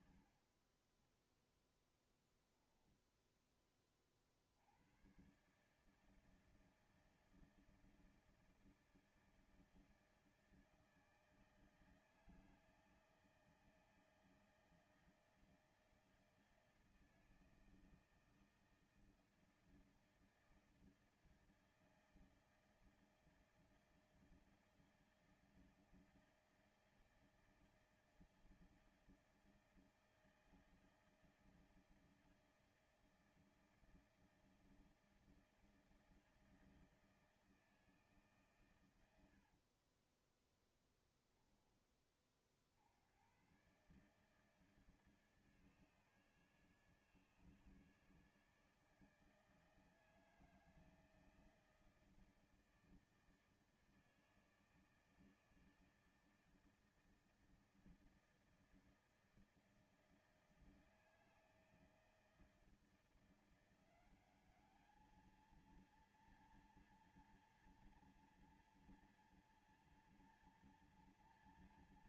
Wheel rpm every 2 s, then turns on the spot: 70, 0, 40, 160, 160, 160, 160, 160, 160, 160, 160, 160, 160, 160, 160, 160, 160, 160, 160, 150, 30, 30, 140, 150, 150, 160, 160, 160, 160, 160, 160, 160, 190, 230, 230, 230.
40-42